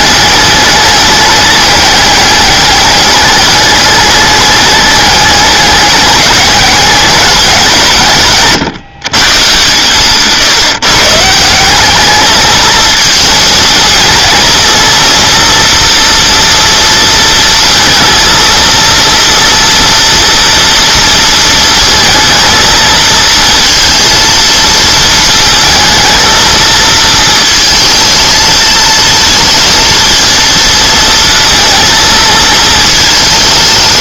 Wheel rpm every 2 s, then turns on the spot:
210, 200, 210, 200, 150, 140, 220, 230, 230, 230, 230, 230, 230, 230, 220, 220, 220.
none